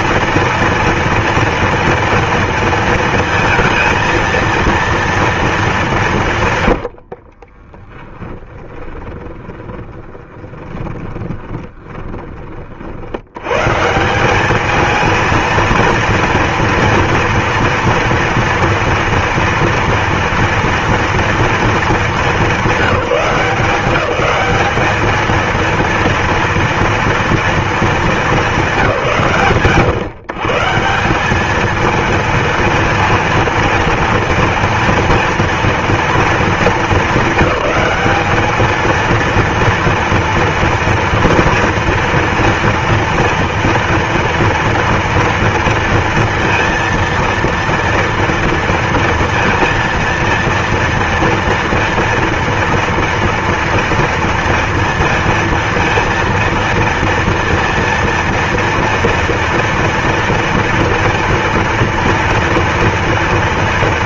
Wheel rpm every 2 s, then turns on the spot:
230, 230, 230, 90, 20, 20, 60, 220, 230, 230, 230, 190, 210, 230, 130, 180, 230, 230, 210, 220, 230, 230, 230, 230, 230, 230, 230, 230, 230, 230, 230, 230.
6-12